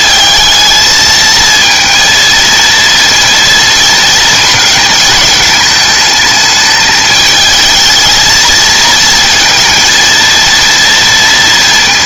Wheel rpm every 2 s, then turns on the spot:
220, 230, 220, 210, 220, 230.
none